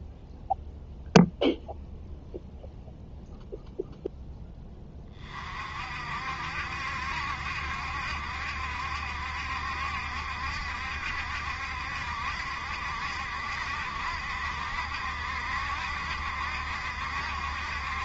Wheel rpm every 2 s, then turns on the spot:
0, 0, 20, 70, 70, 70, 70, 70, 70.
none